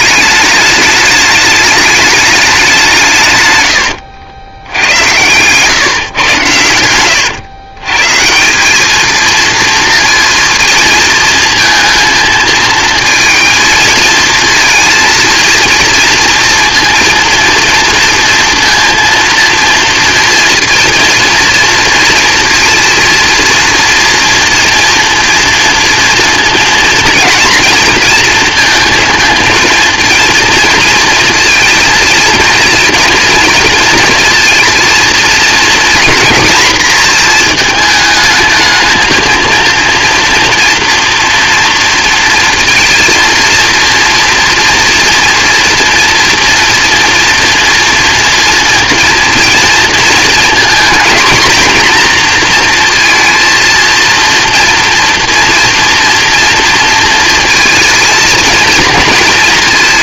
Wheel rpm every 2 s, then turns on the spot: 210, 180, 100, 100, 210, 230, 230, 230, 230, 230, 230, 230, 230, 230, 230, 230, 220, 230, 230, 220, 240, 230, 230, 230, 230, 230, 230, 230, 230, 230.
6-8